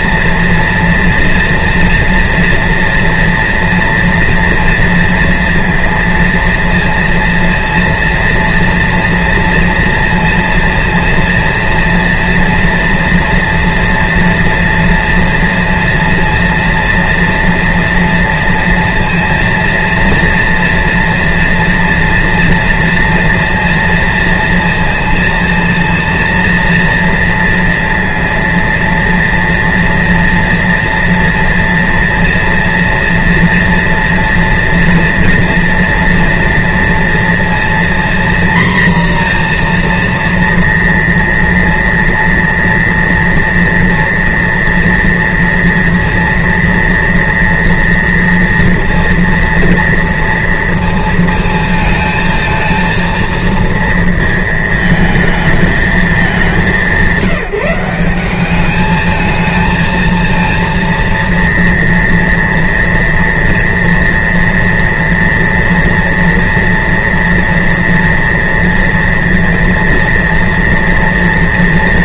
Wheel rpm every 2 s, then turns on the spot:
230, 230, 230, 230, 230, 230, 230, 230, 230, 240, 230, 230, 230, 230, 230, 230, 230, 230, 230, 240, 230, 230, 240, 230, 230, 240, 220, 230, 210, 190, 230, 230, 230, 240, 230, 230.
none